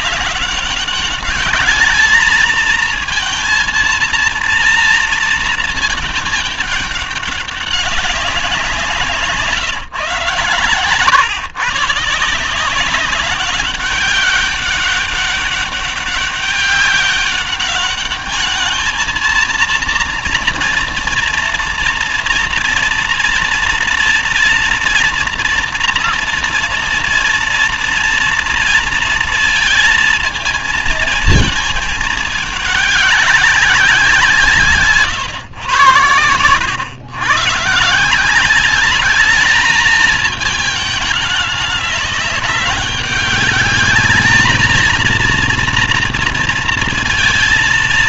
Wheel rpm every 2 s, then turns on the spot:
200, 220, 230, 210, 170, 130, 170, 190, 200, 210, 230, 230, 230, 230, 230, 230, 210, 160, 110, 190, 210, 200, 220, 230.
none